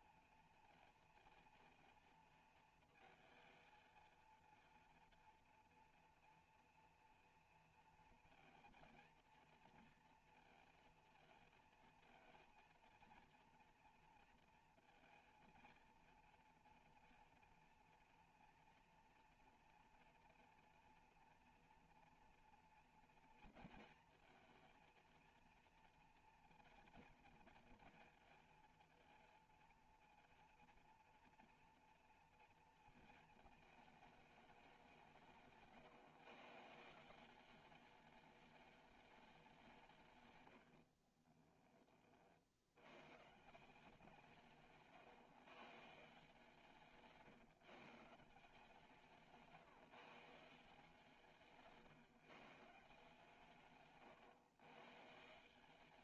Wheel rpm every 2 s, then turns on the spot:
230, 230, 230, 240, 230, 230, 230, 230, 230, 240, 230, 230, 230, 240, 230, 240, 230, 200, 160, 210, 80, 110, 140, 160, 160, 170, 160, 130.
40-42